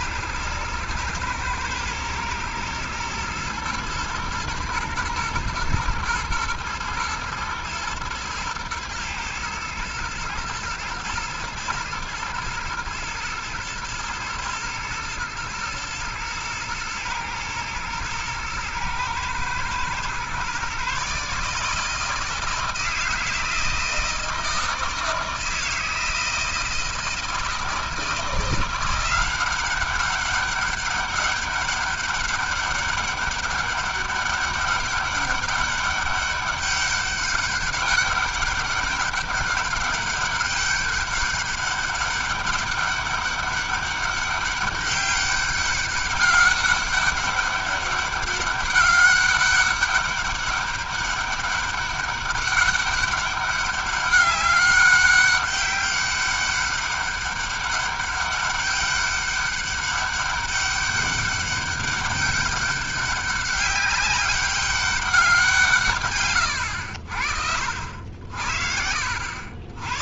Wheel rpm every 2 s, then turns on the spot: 110, 110, 120, 110, 110, 120, 110, 110, 110, 110, 140, 160, 160, 160, 180, 200, 200, 200, 200, 200, 200, 200, 200, 200, 200, 200, 200, 200, 200, 200, 200, 200, 200, 100, 70.
none